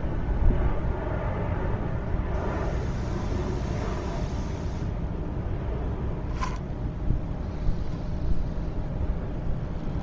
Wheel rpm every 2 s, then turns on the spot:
0, 0, 0, 0, 0.
none